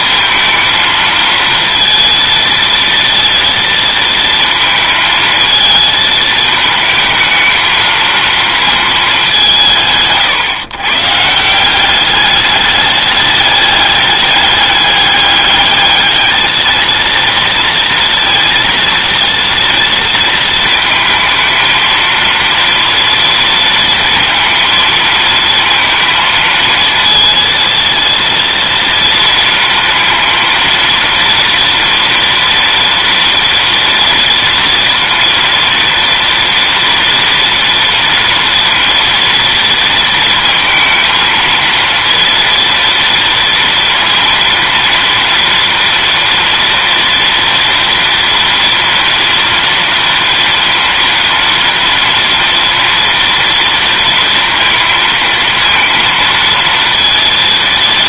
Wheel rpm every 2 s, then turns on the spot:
220, 230, 230, 220, 230, 140, 210, 200, 220, 230, 220, 230, 230, 230, 230, 230, 230, 230, 230, 230, 230, 230, 230, 240, 240, 240, 230, 230, 230.
none